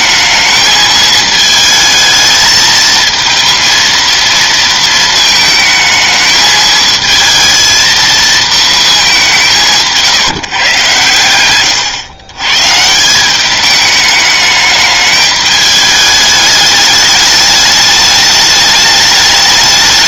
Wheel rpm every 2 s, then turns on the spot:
220, 220, 230, 220, 220, 140, 130, 210, 210, 210.
none